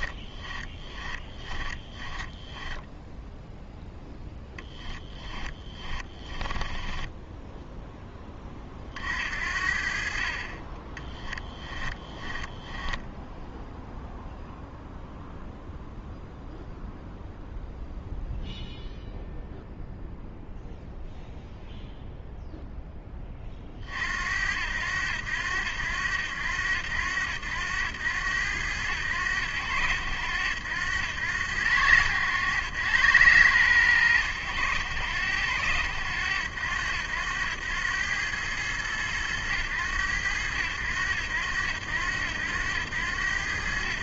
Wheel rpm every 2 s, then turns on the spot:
20, 0, 10, 20, 50, 10, 0, 0, 0, 0, 0, 10, 80, 90, 90, 90, 100, 100, 90, 100, 80, 90.
0-2 4-8 10-12